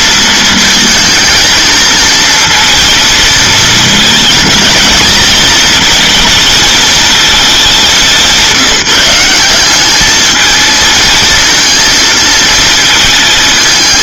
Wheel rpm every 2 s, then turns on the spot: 220, 230, 220, 220, 170, 220, 220.
none